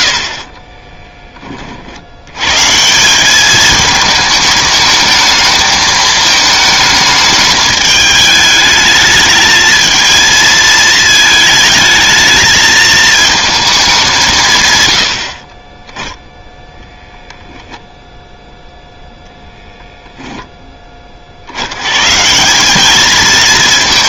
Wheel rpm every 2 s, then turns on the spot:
40, 130, 220, 220, 210, 220, 220, 140, 0, 0, 10, 190.
0-2